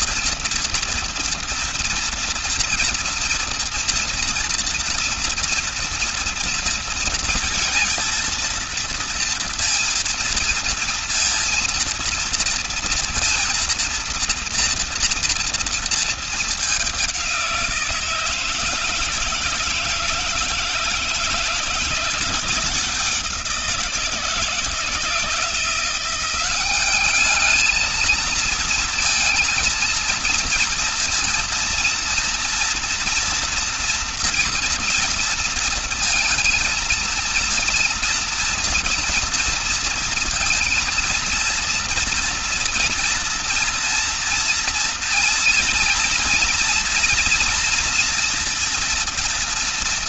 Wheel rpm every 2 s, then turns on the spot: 230, 230, 230, 230, 230, 230, 230, 230, 200, 160, 170, 170, 160, 200, 230, 230, 230, 230, 230, 230, 230, 230, 230, 230, 230.
none